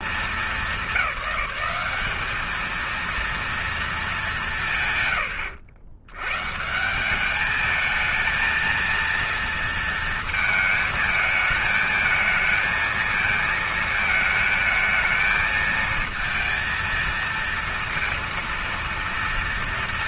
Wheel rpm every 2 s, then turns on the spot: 220, 210, 220, 120, 220, 220, 220, 220, 230, 230.
none